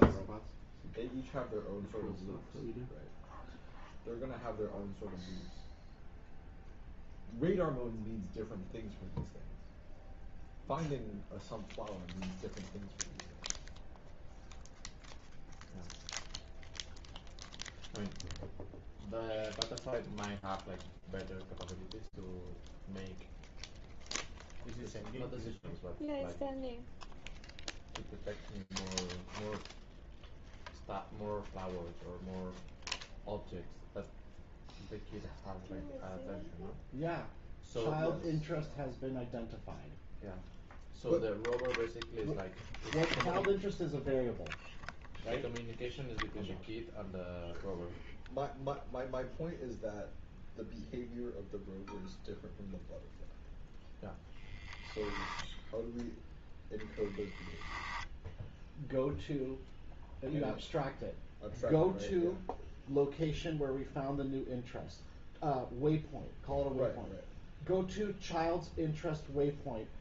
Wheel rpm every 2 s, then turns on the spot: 0, 0, 0, 0, 0, 0, 0, 0, 0, 0, 0, 0, 0, 0, 0, 0, 0, 0, 0, 0, 0, 0, 0, 0, 0, 0, 0, 0, 0, 0, 0, 0, 0, 0, 0.
none